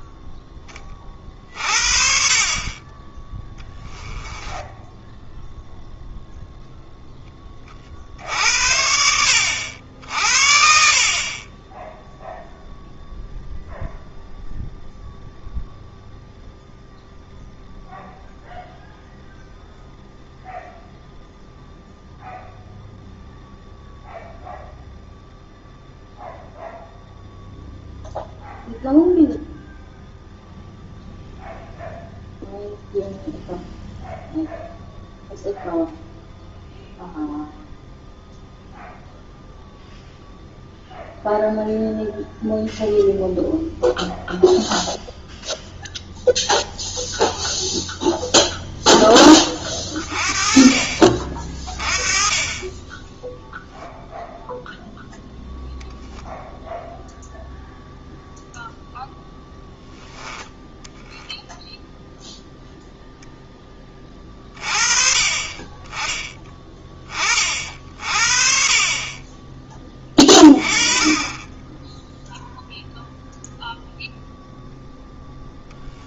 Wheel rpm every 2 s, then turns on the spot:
20, 30, 10, 0, 70, 50, 0, 0, 0, 0, 0, 0, 0, 0, 0, 0, 0, 0, 0, 0, 0, 0, 0, 0, 0, 40, 20, 0, 0, 0, 10, 0, 30, 10, 40, 20, 0, 0.
4-6